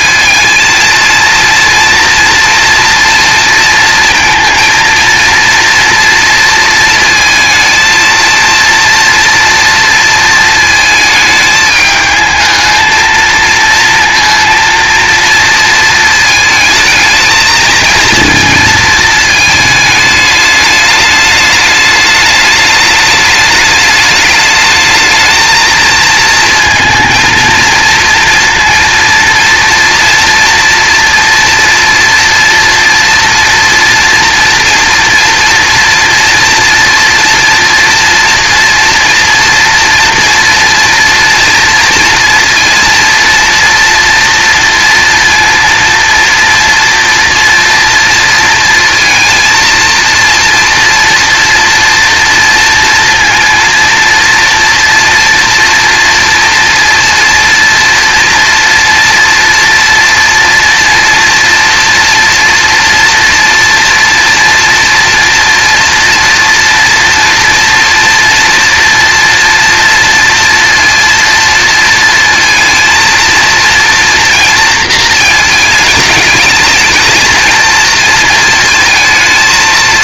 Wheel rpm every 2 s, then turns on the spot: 230, 230, 230, 230, 230, 220, 230, 230, 220, 220, 210, 210, 220, 230, 230, 230, 230, 230, 230, 240, 230, 230, 230, 230, 230, 230, 230, 230, 230, 230, 230, 230, 230, 230, 230, 230, 230, 230, 220, 220.
none